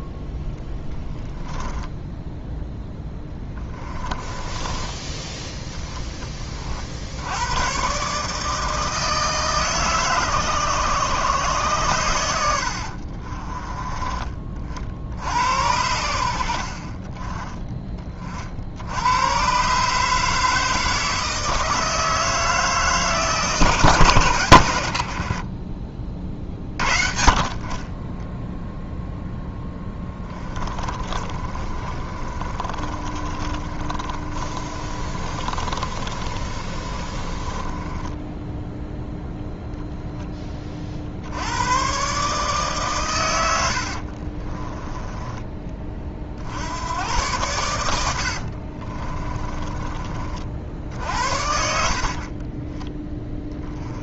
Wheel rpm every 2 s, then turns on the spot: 10, 10, 20, 40, 160, 140, 80, 50, 60, 70, 160, 160, 100, 40, 0, 20, 30, 30, 30, 0, 30, 140, 20, 80, 50, 60, 20.
2-6 30-38 44-46 48-50 52-54